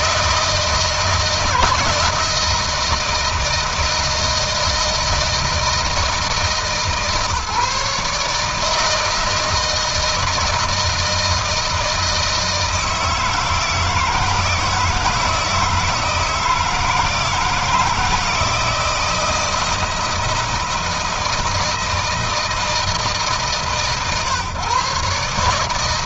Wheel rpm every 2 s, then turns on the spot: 160, 160, 160, 140, 150, 160, 160, 160, 160, 160, 160, 160, 130.
none